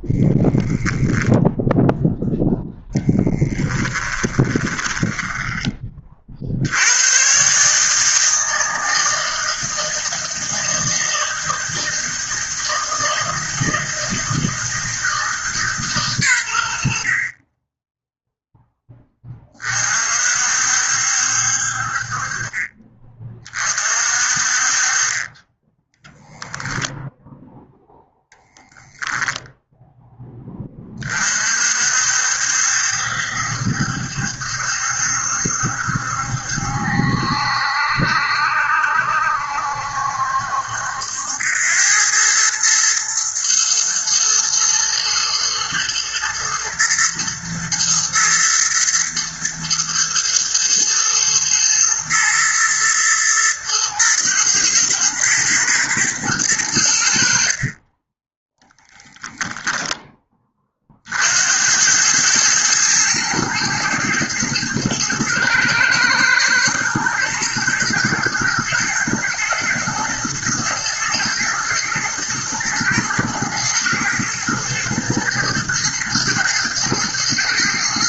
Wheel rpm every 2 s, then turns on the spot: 0, 0, 10, 90, 160, 160, 160, 160, 70, 10, 60, 30, 30, 10, 0, 30, 70, 70, 70, 70, 80, 110, 110, 110, 120, 110, 120, 110, 80, 10, 40, 110, 120, 120, 120, 110, 110, 120, 110.
4-6 58-60